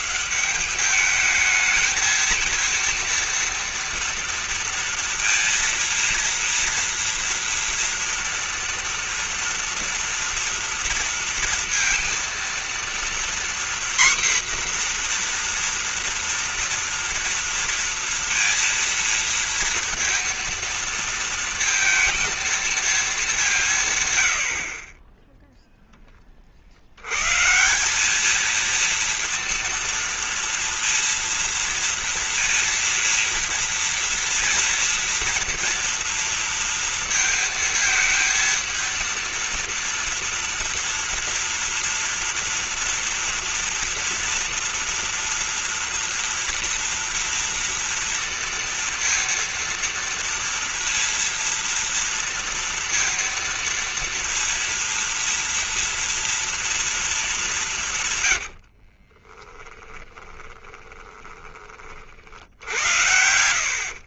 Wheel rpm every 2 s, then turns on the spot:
180, 230, 230, 230, 230, 230, 230, 250, 240, 230, 230, 230, 80, 40, 220, 230, 230, 230, 230, 230, 230, 240, 230, 230, 230, 230, 230, 230, 230, 90, 20, 60.
58-62